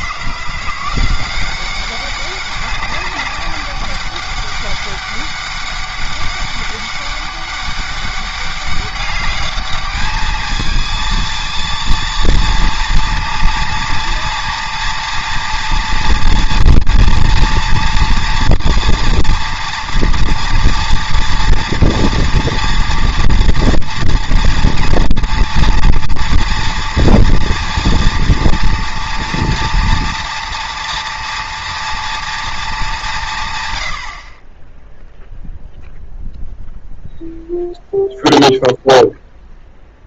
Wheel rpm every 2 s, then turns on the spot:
180, 200, 200, 200, 200, 220, 230, 230, 230, 230, 230, 240, 230, 230, 230, 230, 200, 0, 0, 0.
none